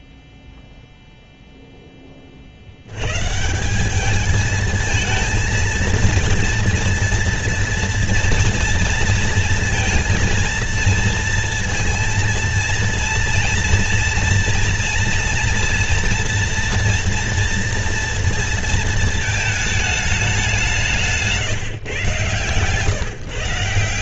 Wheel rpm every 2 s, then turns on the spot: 0, 80, 220, 230, 230, 230, 230, 230, 240, 230, 190, 130.
none